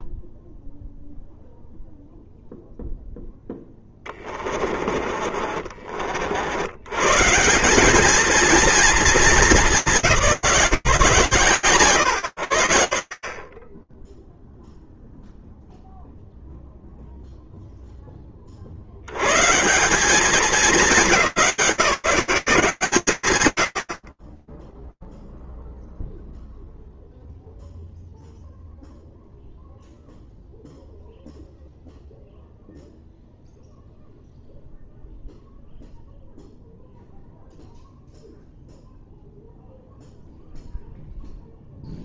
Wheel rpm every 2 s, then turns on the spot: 0, 0, 20, 60, 220, 190, 110, 10, 0, 40, 190, 180, 10, 0, 0, 0, 0, 0, 0, 0, 0.
4-6 14-16